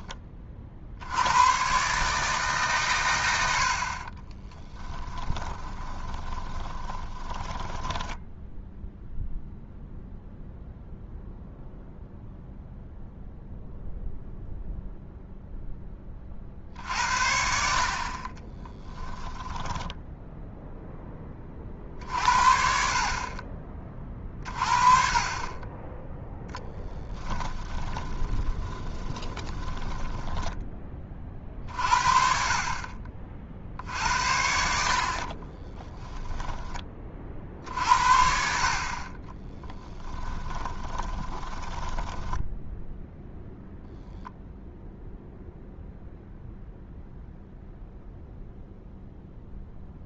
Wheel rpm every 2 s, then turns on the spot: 60, 130, 10, 20, 0, 0, 0, 0, 60, 10, 10, 50, 30, 10, 20, 20, 40, 70, 20, 50, 20, 0, 0, 0, 0.
4-8 18-20 26-30 40-42